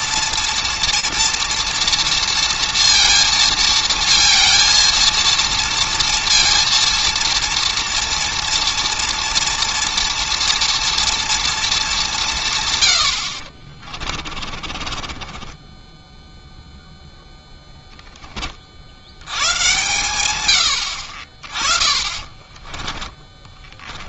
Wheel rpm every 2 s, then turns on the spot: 240, 230, 230, 230, 230, 230, 140, 30, 0, 90, 60, 20.
14-16 22-24